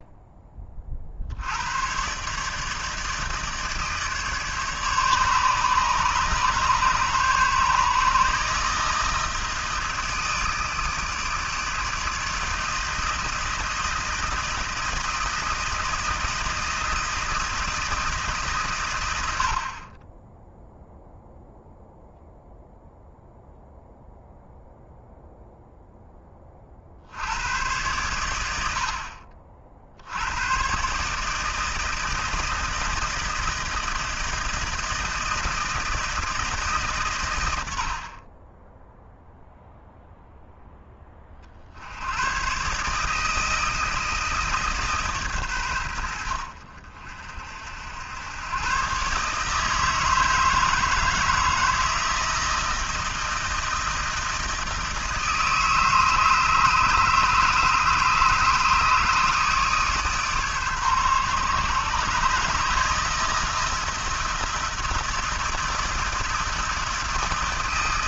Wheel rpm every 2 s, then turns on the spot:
40, 150, 150, 140, 160, 160, 160, 160, 160, 120, 0, 0, 0, 50, 40, 130, 160, 160, 150, 10, 10, 140, 150, 60, 130, 160, 160, 160, 150, 150, 140, 150, 160, 150.
none